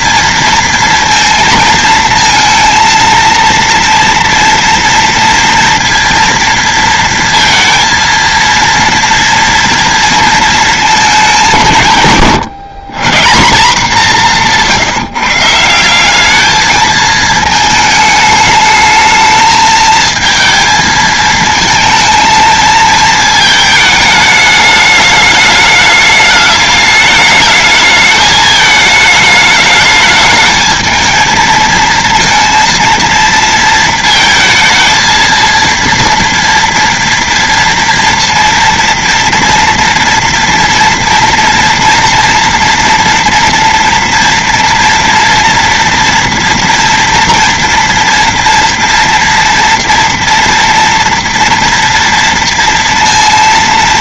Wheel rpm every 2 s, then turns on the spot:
230, 230, 230, 230, 230, 230, 140, 180, 190, 210, 220, 230, 220, 210, 210, 210, 230, 230, 230, 230, 230, 240, 240, 240, 230, 230, 230.
none